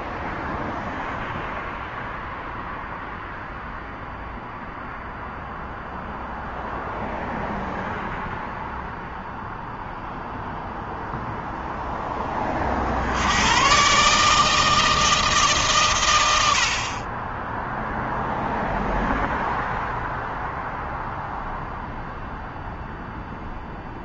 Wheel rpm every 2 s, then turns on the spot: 0, 0, 0, 0, 0, 0, 70, 160, 40, 0, 0, 0.
none